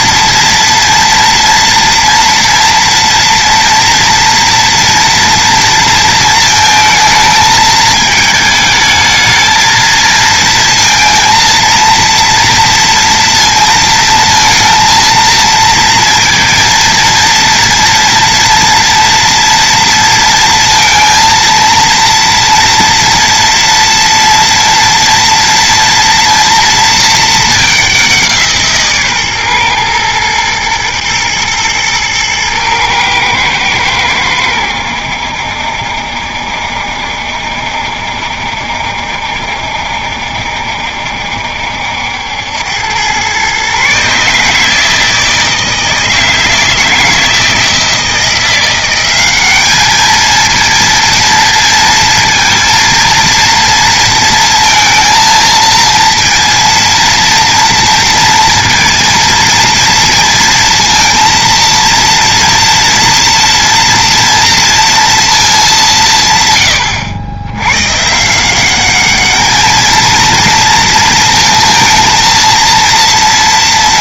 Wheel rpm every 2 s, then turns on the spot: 230, 230, 230, 220, 220, 230, 230, 230, 230, 230, 230, 230, 230, 230, 160, 120, 110, 90, 70, 70, 70, 90, 160, 160, 180, 230, 230, 230, 230, 230, 230, 240, 230, 110, 180, 230, 230.
none